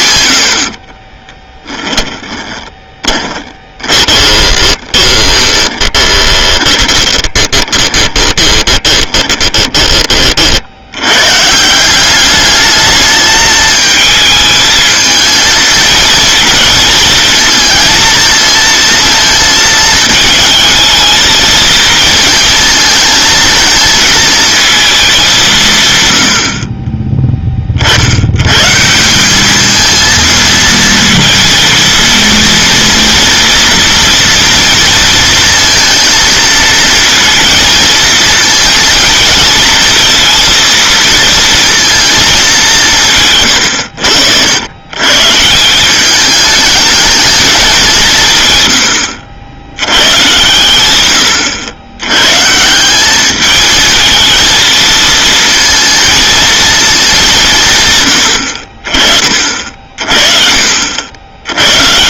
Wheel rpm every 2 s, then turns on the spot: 40, 20, 20, 20, 20, 90, 210, 220, 230, 230, 220, 230, 210, 30, 170, 230, 230, 230, 230, 230, 230, 170, 120, 210, 110, 110, 180, 220, 210, 40, 60.
0-10